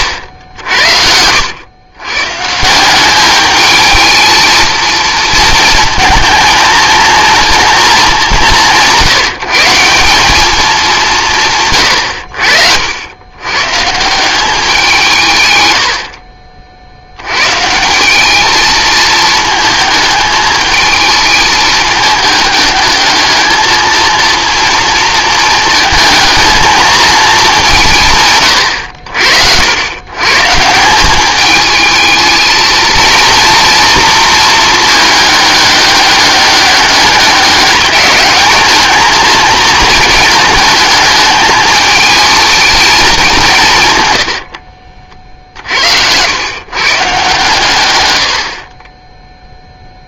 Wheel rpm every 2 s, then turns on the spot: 80, 150, 220, 220, 180, 200, 60, 180, 60, 220, 220, 210, 230, 220, 120, 160, 220, 230, 200, 210, 220, 220, 60, 120, 40.
44-46